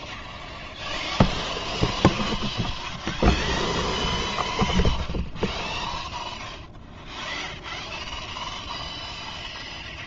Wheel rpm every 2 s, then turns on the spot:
0, 0, 0, 0, 0.
none